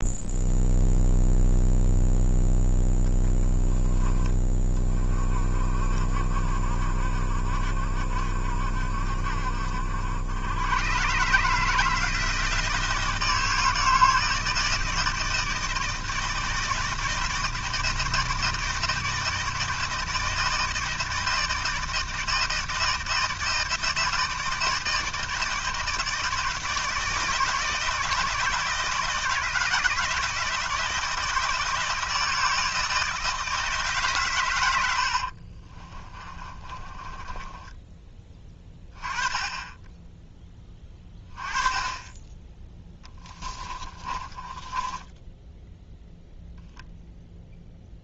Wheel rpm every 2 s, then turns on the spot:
0, 0, 30, 50, 50, 130, 160, 160, 160, 160, 160, 160, 160, 160, 160, 160, 160, 80, 20, 20, 20, 10, 10, 0.
34-38 42-46